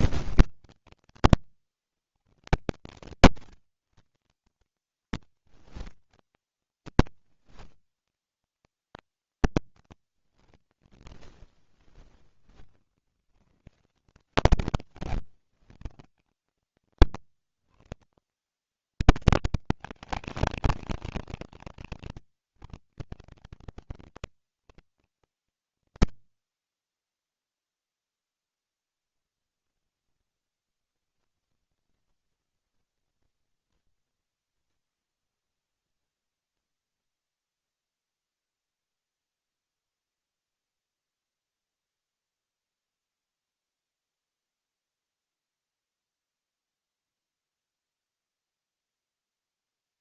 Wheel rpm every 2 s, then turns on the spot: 110, 120, 140, 130, 120, 60, 60, 160, 160, 190, 230, 170, 150, 20, 0, 0, 0, 0, 0, 0, 0, 0, 0, 0, 0.
none